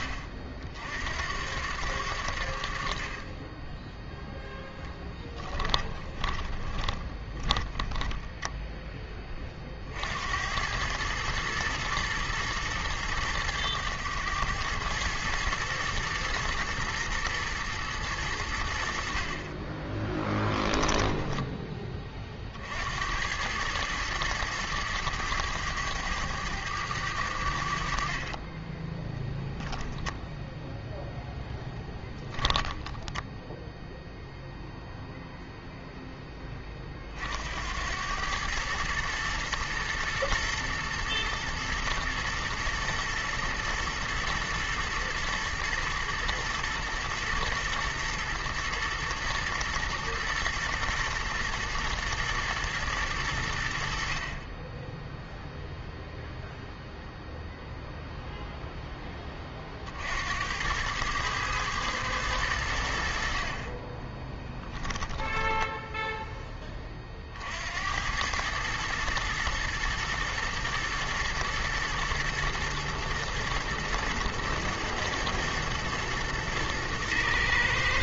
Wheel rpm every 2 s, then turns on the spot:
60, 50, 10, 20, 10, 100, 110, 110, 110, 70, 10, 70, 110, 100, 10, 0, 10, 0, 30, 110, 110, 110, 110, 110, 110, 110, 110, 20, 0, 0, 90, 80, 20, 20, 110, 110, 110, 110, 110.
4-8 20-22 32-34 64-66